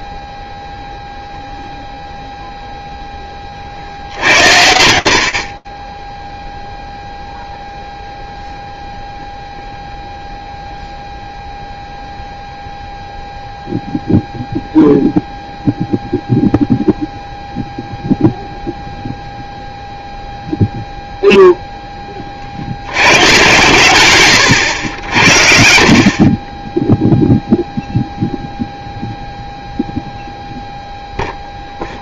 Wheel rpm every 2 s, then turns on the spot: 0, 40, 40, 0, 0, 0, 0, 0, 0, 0, 0, 120, 70, 0, 0, 0.
none